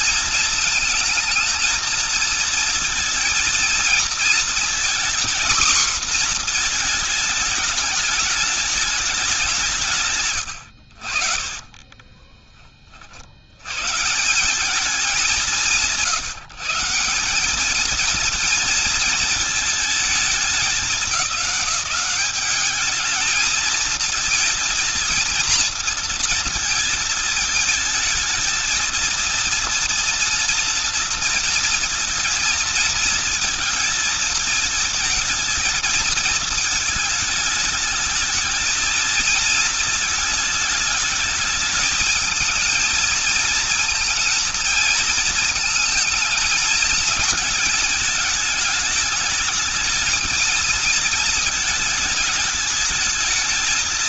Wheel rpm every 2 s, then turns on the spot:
230, 230, 240, 230, 210, 80, 40, 200, 170, 220, 200, 210, 230, 220, 220, 230, 220, 220, 220, 220, 220, 220, 230, 220, 220, 220, 220.
none